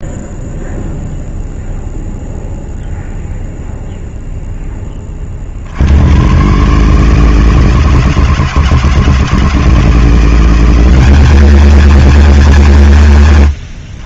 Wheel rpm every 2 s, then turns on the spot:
0, 0, 30, 150, 160, 190, 180.
none